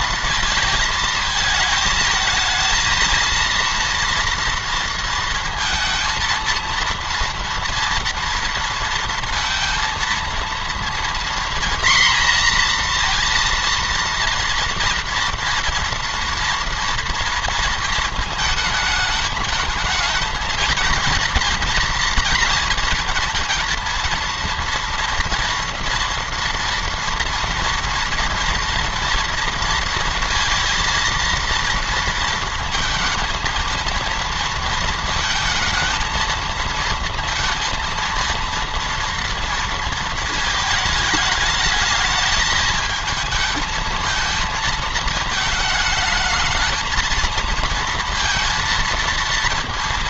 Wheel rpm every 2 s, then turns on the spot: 220, 230, 230, 230, 230, 230, 230, 230, 230, 220, 230, 240, 230, 230, 230, 230, 220, 230, 230, 230, 220, 220, 220, 220, 230.
none